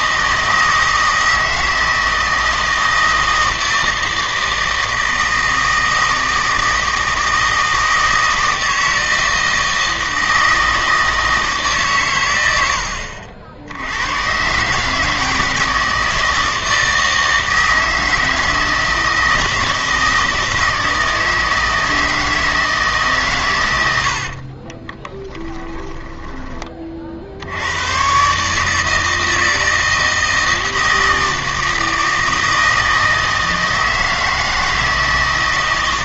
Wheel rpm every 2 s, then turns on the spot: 160, 160, 160, 160, 160, 160, 80, 150, 160, 160, 160, 150, 30, 30, 150, 160, 160, 160.
24-26